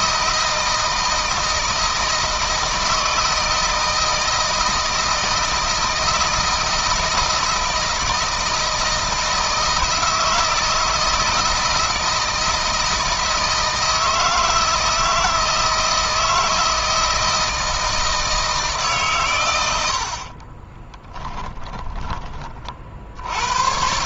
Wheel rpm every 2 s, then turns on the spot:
160, 160, 160, 160, 160, 160, 160, 160, 160, 150, 30, 50.
20-22